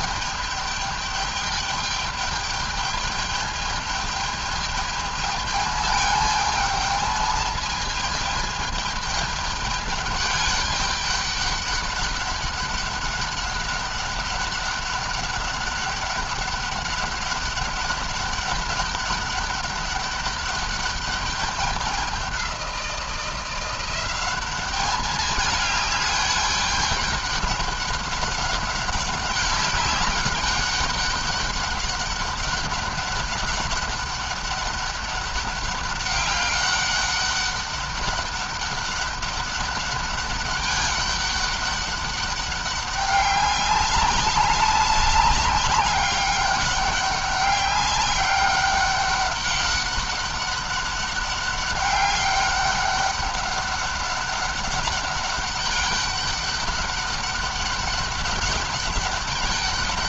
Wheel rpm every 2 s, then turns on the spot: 210, 210, 210, 220, 210, 200, 200, 200, 200, 200, 200, 190, 200, 200, 200, 200, 200, 200, 200, 200, 200, 200, 190, 200, 200, 190, 200, 200, 200, 200.
none